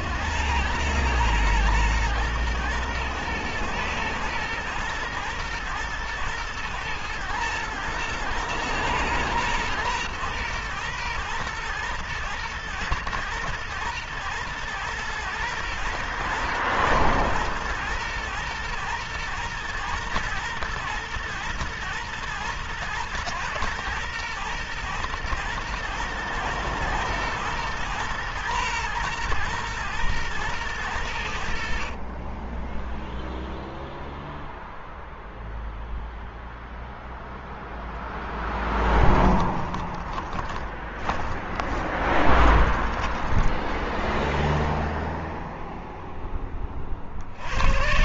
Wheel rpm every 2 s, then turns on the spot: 110, 120, 120, 110, 110, 120, 120, 110, 110, 120, 120, 110, 110, 120, 120, 90, 0, 0, 0, 10, 10, 10, 0, 50.
38-44 46-48